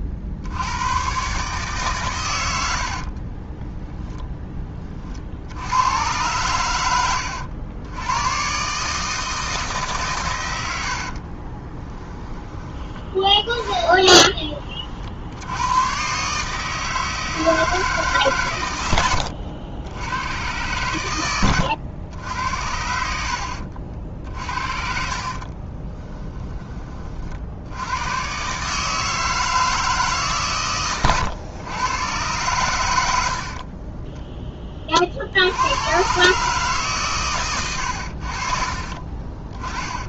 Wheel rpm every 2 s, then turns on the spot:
110, 70, 40, 90, 150, 60, 20, 50, 160, 100, 100, 80, 50, 30, 150, 120, 90, 40, 130, 40.
2-4 10-12 24-26